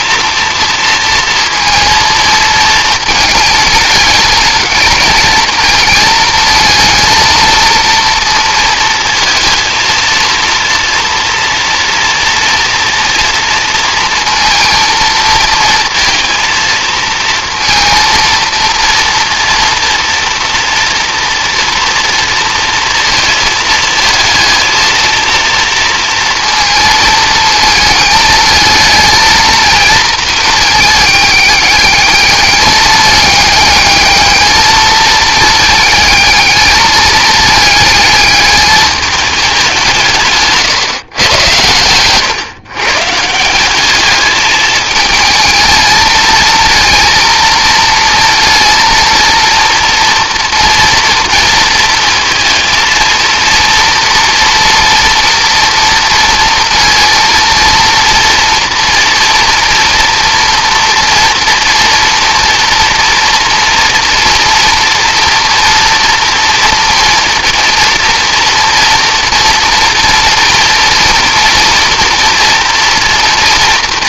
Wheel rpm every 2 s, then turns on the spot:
230, 230, 210, 220, 230, 230, 230, 230, 230, 230, 230, 230, 230, 230, 220, 220, 210, 220, 220, 210, 140, 130, 210, 230, 230, 230, 220, 230, 230, 230, 240, 230, 230, 230, 230, 230, 230.
none